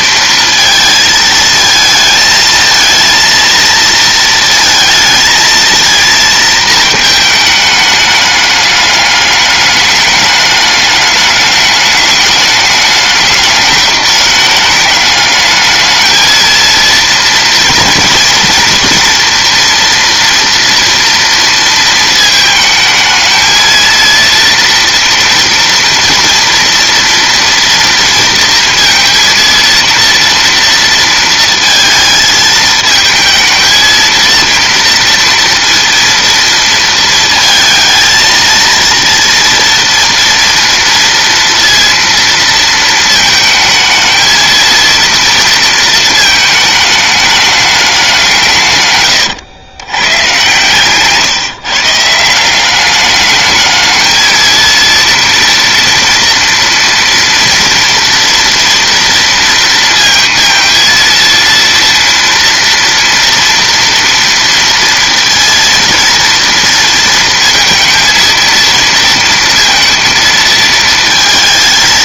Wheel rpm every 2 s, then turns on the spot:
220, 230, 220, 220, 210, 200, 200, 210, 230, 240, 230, 220, 230, 230, 230, 230, 220, 230, 230, 230, 230, 230, 230, 210, 140, 140, 200, 230, 230, 230, 230, 230, 230, 230, 230, 230.
50-52